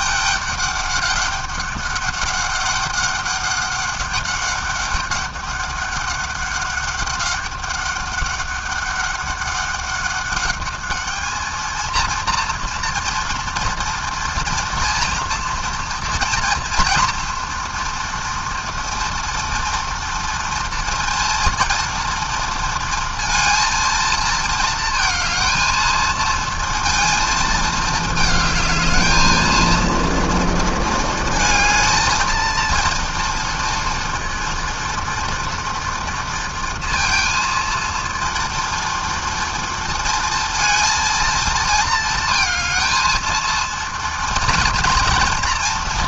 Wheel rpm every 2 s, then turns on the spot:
200, 200, 200, 200, 200, 220, 230, 230, 230, 230, 230, 230, 220, 220, 220, 230, 230, 230, 230, 230, 230, 220, 230.
none